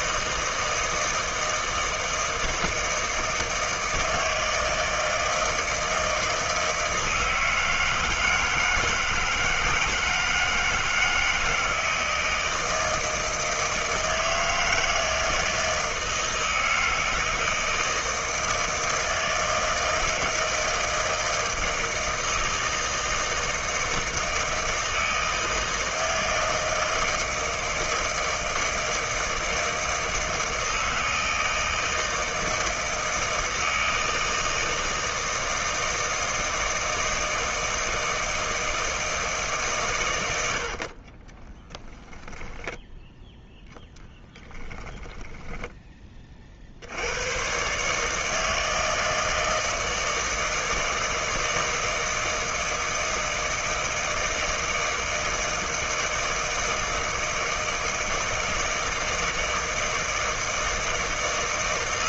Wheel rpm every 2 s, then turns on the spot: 160, 160, 160, 160, 160, 160, 160, 160, 160, 160, 160, 160, 160, 160, 160, 160, 160, 160, 160, 160, 60, 10, 10, 50, 160, 160, 160, 160, 160, 160, 160.
40-46